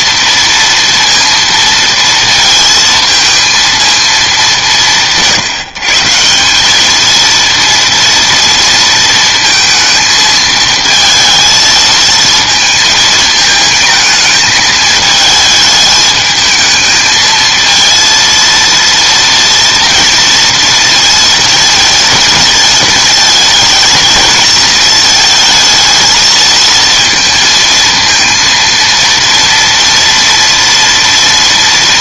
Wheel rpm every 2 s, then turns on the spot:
230, 230, 190, 200, 230, 220, 230, 220, 220, 230, 230, 220, 220, 230, 230, 230.
none